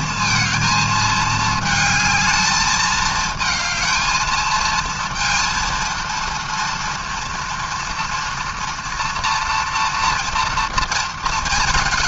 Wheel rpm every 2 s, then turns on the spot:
230, 220, 230, 230, 230, 230.
none